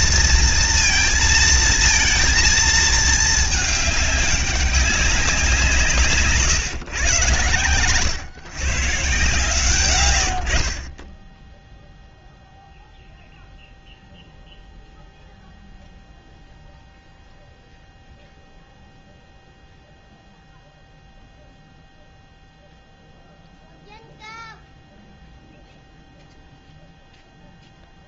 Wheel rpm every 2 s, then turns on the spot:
230, 230, 190, 140, 140, 30, 0, 0, 0, 0, 0, 0, 0, 0.
none